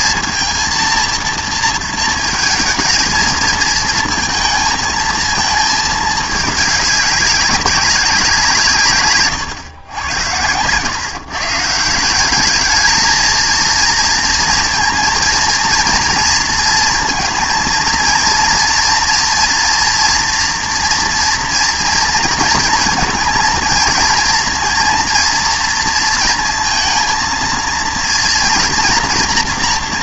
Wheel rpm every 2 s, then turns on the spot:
230, 220, 230, 210, 170, 100, 210, 230, 230, 230, 230, 220, 230, 230, 230.
none